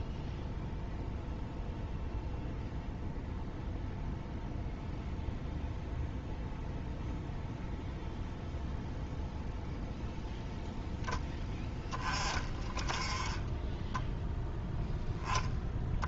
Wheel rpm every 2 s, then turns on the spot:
0, 0, 0, 0, 0, 10, 20, 0.
none